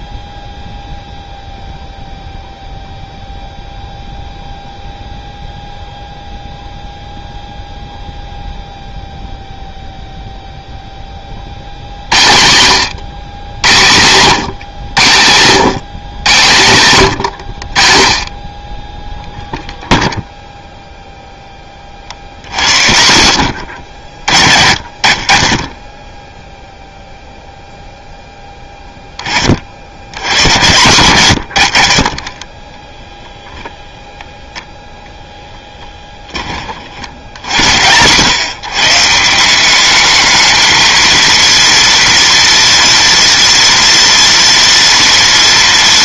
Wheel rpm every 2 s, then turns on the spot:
0, 0, 0, 0, 0, 10, 120, 130, 120, 20, 0, 70, 70, 0, 10, 110, 10, 0, 50, 140, 220, 230, 230.
none